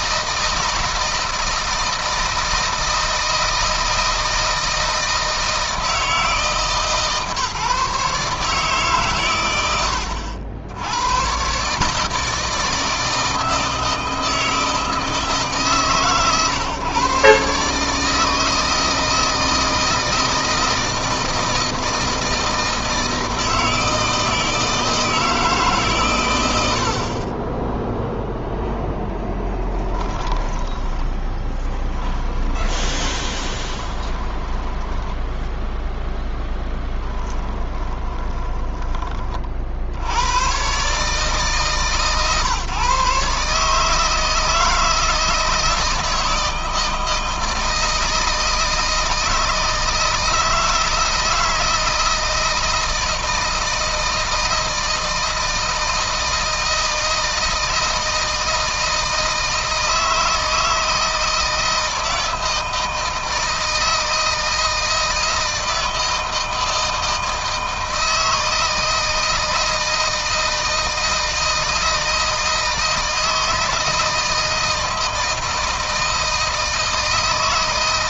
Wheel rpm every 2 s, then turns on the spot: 160, 160, 160, 160, 140, 90, 160, 160, 130, 160, 170, 160, 160, 90, 0, 10, 20, 10, 10, 20, 130, 150, 160, 160, 160, 160, 160, 160, 160, 160, 160, 160, 160, 160, 160, 160, 160, 160, 160.
30-38